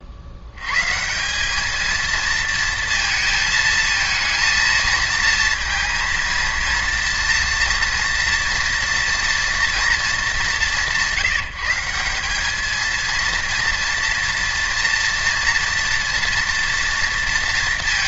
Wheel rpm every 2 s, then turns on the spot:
100, 230, 220, 230, 240, 180, 210, 230, 230.
none